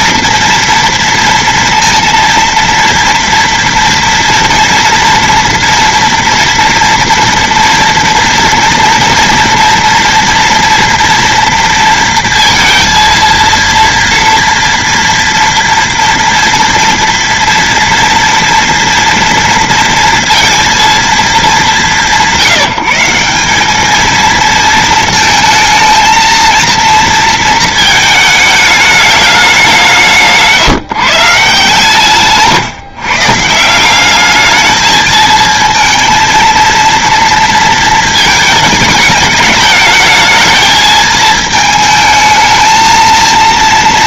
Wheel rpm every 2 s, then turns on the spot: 230, 230, 230, 240, 240, 240, 230, 230, 230, 230, 230, 170, 220, 230, 210, 160, 140, 210, 230, 210, 220, 220.
none